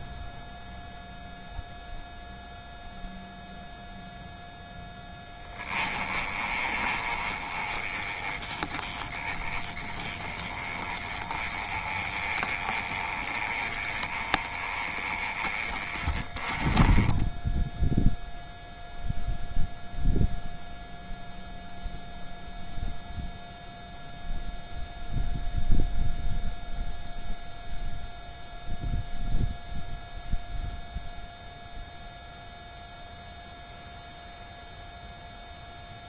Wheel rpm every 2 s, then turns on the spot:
0, 0, 10, 30, 20, 20, 20, 20, 10, 0, 0, 0, 0, 0, 0, 0, 0, 0.
none